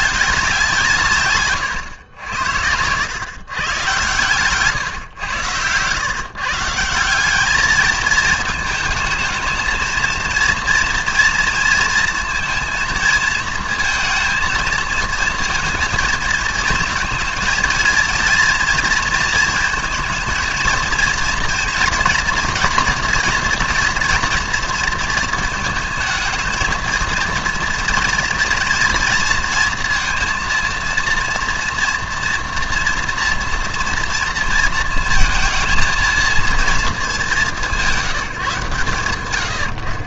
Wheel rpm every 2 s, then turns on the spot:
180, 90, 130, 150, 220, 230, 230, 230, 220, 230, 230, 230, 230, 220, 230, 230, 240, 230, 220, 160.
none